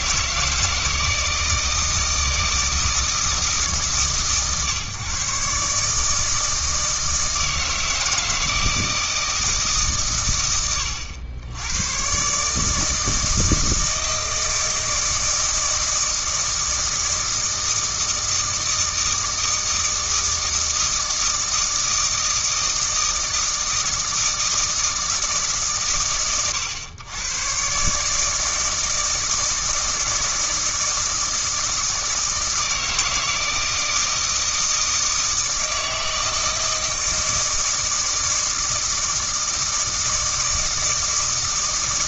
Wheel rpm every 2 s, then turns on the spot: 160, 160, 140, 160, 160, 100, 150, 160, 160, 160, 160, 160, 160, 90, 160, 160, 160, 160, 160, 160, 160.
none